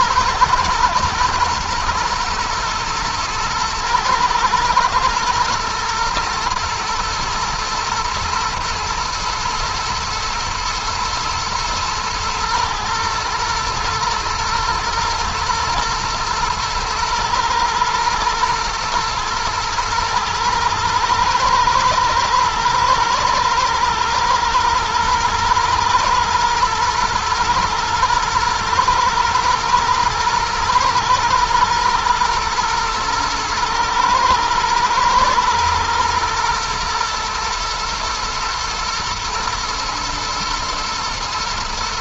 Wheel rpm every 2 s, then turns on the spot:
120, 120, 110, 120, 120, 110, 120, 120, 110, 110, 110, 110, 110, 120, 110, 110, 110, 110, 120, 120, 110.
none